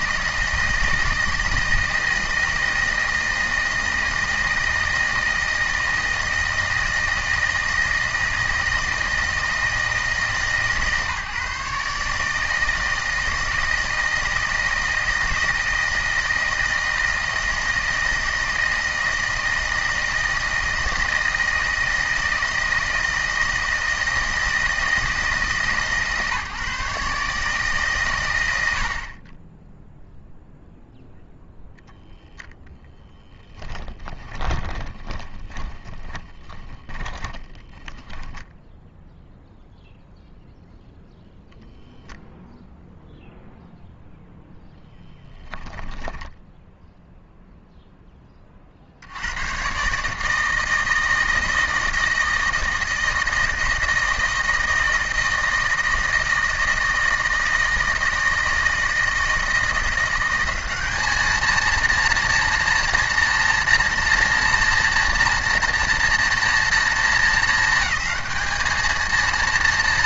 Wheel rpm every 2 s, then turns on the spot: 160, 160, 160, 160, 160, 150, 160, 160, 160, 160, 160, 160, 160, 150, 70, 0, 10, 30, 20, 0, 0, 0, 0, 0, 50, 160, 160, 160, 160, 160, 200, 230, 230, 230, 220.
34-38